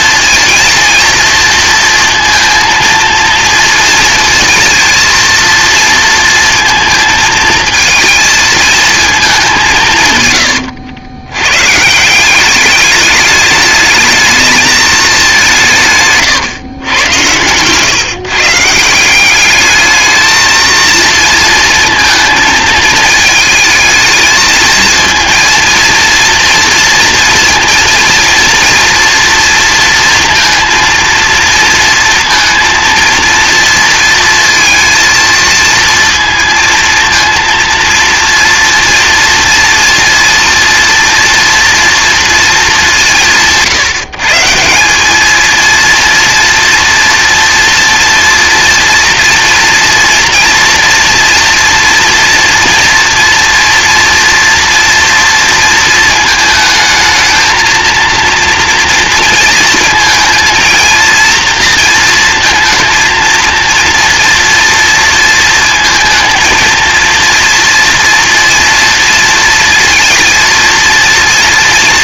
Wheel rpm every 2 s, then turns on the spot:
230, 230, 230, 230, 230, 90, 190, 220, 130, 160, 220, 220, 220, 230, 230, 230, 230, 230, 230, 230, 230, 220, 180, 230, 230, 230, 230, 240, 220, 230, 230, 230, 230, 230, 230, 230.
none